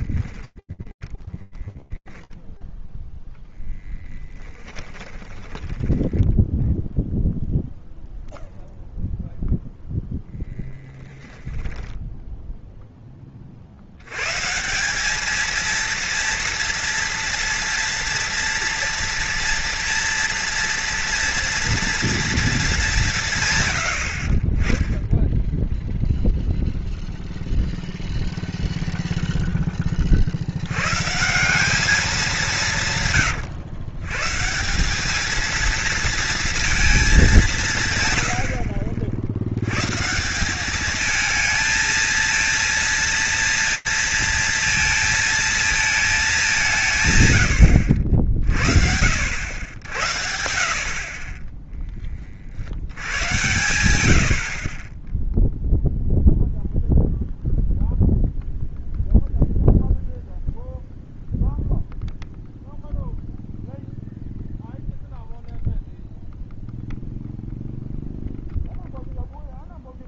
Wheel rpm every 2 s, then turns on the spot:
10, 0, 10, 0, 0, 10, 20, 220, 230, 230, 230, 170, 10, 0, 0, 170, 130, 220, 190, 80, 220, 230, 230, 110, 70, 20, 90, 0, 0, 0, 0, 0, 0, 0, 0.
0-2 4-6 10-12 50-52